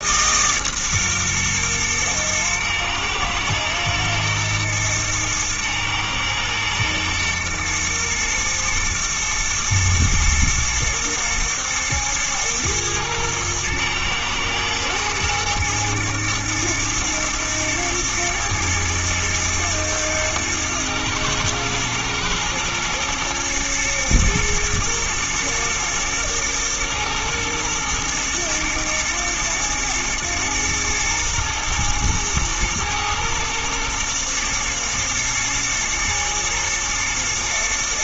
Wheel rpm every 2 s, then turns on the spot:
130, 110, 110, 110, 110, 110, 110, 110, 110, 110, 110, 120, 110, 120, 120, 120, 110, 120, 120.
none